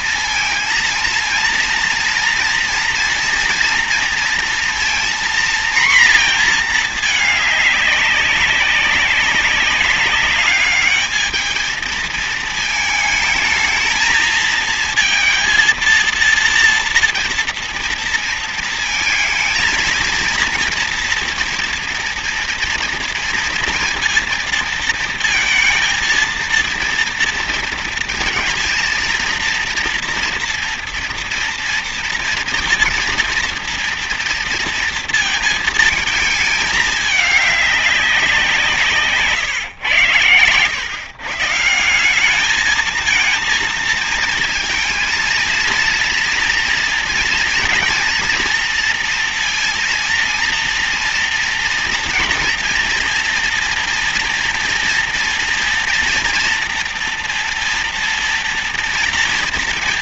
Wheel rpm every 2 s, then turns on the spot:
230, 230, 230, 230, 200, 210, 220, 230, 230, 230, 230, 230, 230, 230, 230, 230, 240, 230, 220, 170, 130, 210, 230, 230, 230, 230, 230, 230, 230, 230.
none